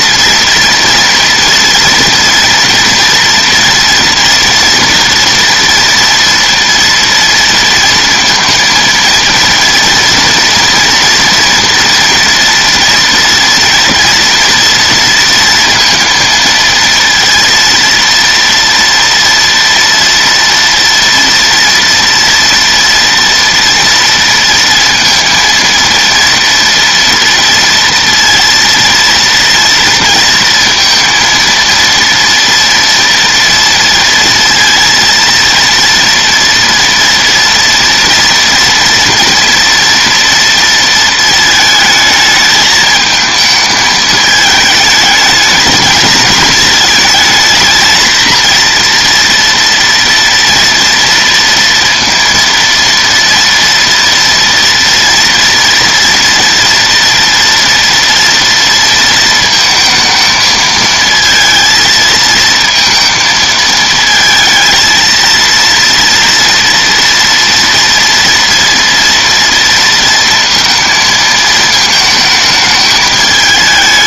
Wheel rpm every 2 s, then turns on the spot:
240, 240, 240, 230, 230, 230, 230, 230, 230, 230, 230, 240, 230, 230, 230, 230, 230, 230, 230, 230, 230, 220, 220, 220, 230, 230, 230, 230, 240, 230, 220, 220, 230, 240, 230, 220, 220.
none